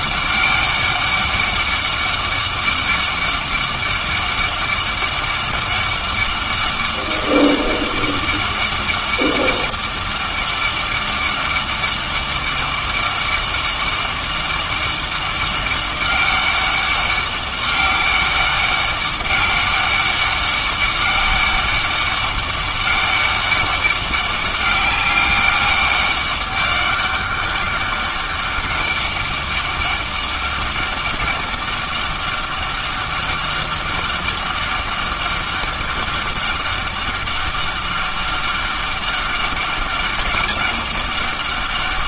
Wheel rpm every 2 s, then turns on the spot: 200, 200, 200, 200, 200, 200, 200, 200, 200, 190, 200, 200, 200, 200, 200, 200, 200, 200, 200, 200, 200.
none